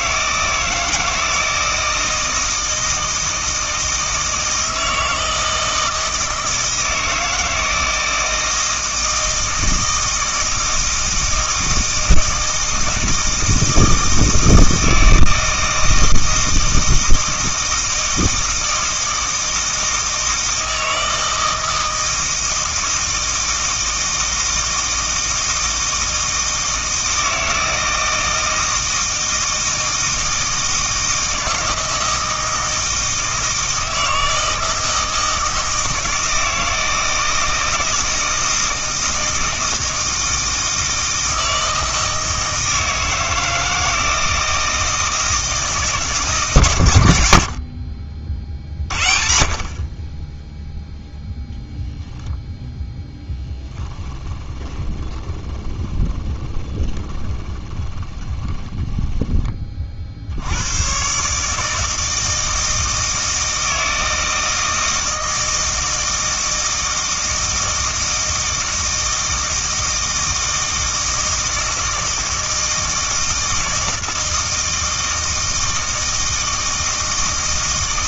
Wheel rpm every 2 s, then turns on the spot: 160, 160, 160, 160, 160, 160, 160, 160, 160, 160, 160, 160, 160, 160, 160, 160, 160, 160, 160, 160, 160, 160, 160, 120, 50, 0, 0, 20, 10, 10, 110, 160, 160, 160, 160, 160, 160, 160, 160.
54-60